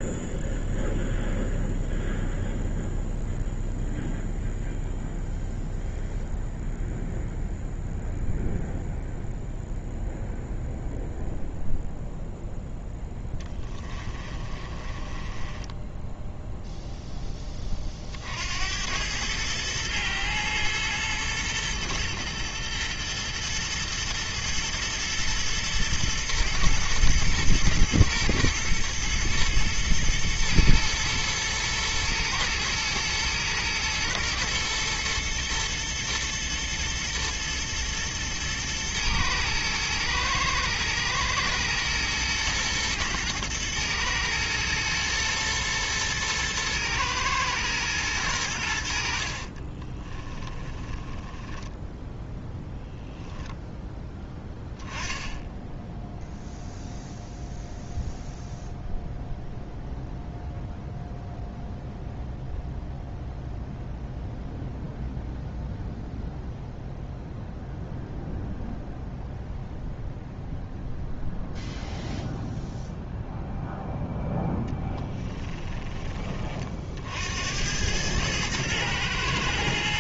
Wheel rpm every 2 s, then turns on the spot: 0, 0, 0, 0, 0, 0, 0, 30, 0, 90, 110, 110, 120, 120, 110, 110, 110, 110, 120, 110, 110, 120, 120, 110, 80, 20, 0, 10, 0, 0, 0, 0, 0, 0, 0, 0, 0, 10, 40, 110.
14-16 50-52 74-76